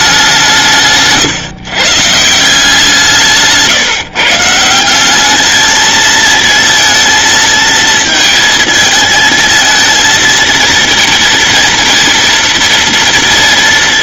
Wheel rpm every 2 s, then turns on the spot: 160, 170, 180, 230, 220, 230, 230.
none